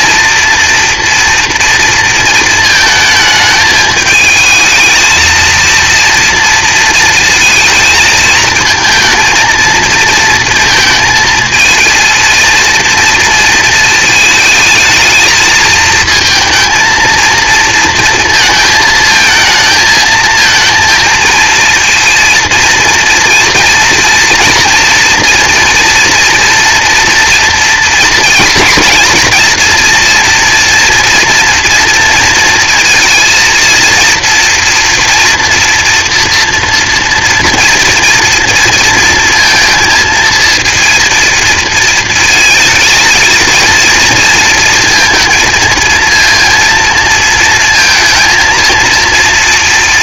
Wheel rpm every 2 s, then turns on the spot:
230, 220, 220, 230, 220, 230, 230, 220, 230, 230, 230, 230, 230, 230, 230, 240, 220, 230, 240, 230, 230, 220, 220, 230, 230.
none